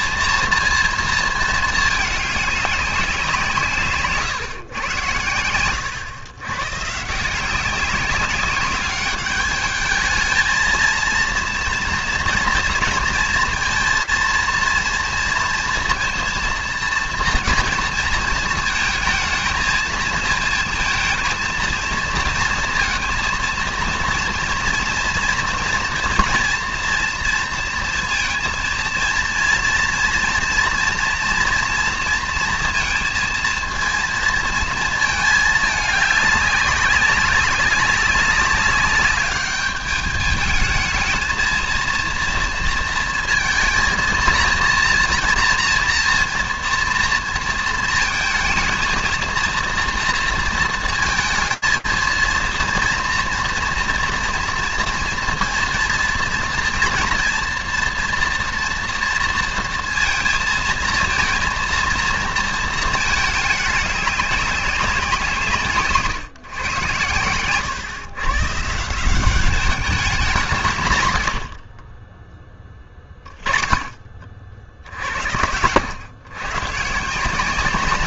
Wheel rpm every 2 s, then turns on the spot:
230, 190, 110, 140, 200, 230, 230, 230, 230, 220, 230, 230, 230, 230, 230, 230, 230, 220, 190, 210, 220, 230, 230, 230, 230, 230, 230, 230, 230, 240, 230, 220, 190, 110, 150, 160, 10, 60, 130.
none